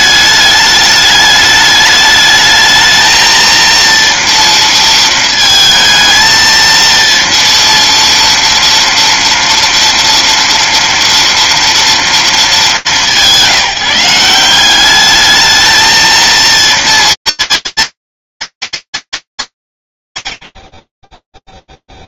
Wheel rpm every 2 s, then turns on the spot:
210, 220, 230, 230, 230, 240, 190, 190, 230, 230, 100.
none